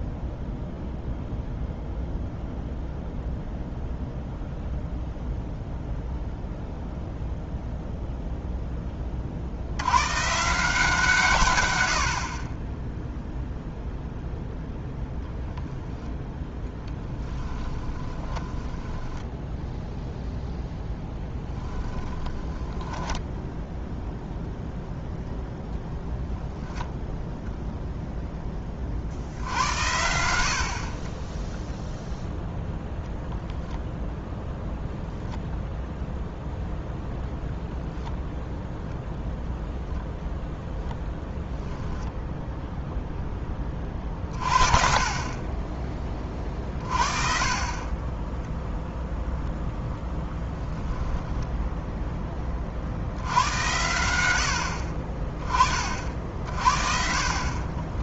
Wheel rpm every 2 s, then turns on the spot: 0, 0, 0, 0, 10, 160, 20, 0, 0, 10, 0, 10, 0, 10, 30, 50, 0, 0, 0, 0, 0, 0, 40, 40, 0, 10, 50, 50, 50.
18-20 22-24 50-52